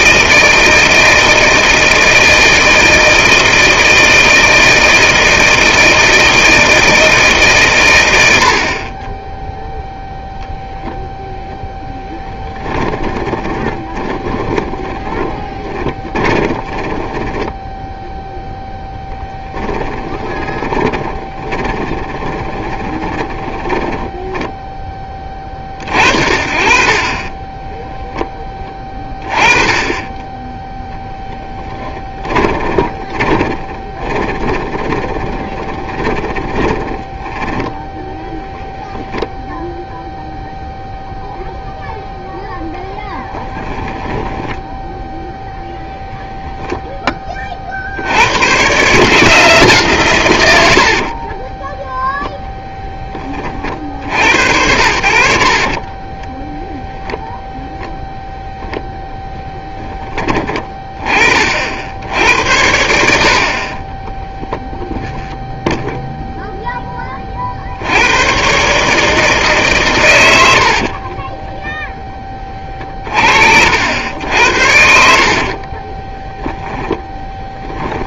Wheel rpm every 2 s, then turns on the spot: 170, 160, 160, 160, 60, 0, 10, 30, 20, 0, 20, 20, 10, 40, 20, 10, 10, 20, 10, 0, 0, 0, 10, 0, 120, 90, 0, 70, 10, 0, 20, 80, 10, 10, 140, 70, 30, 80, 20.
12-18 20-26 32-38 56-58 64-66 70-72 74-78